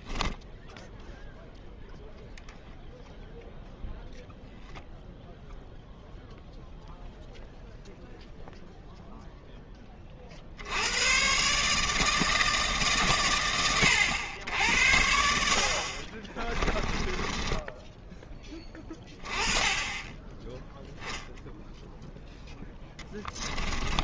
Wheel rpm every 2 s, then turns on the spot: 0, 0, 0, 0, 0, 110, 120, 60, 10, 20, 0, 10.
16-18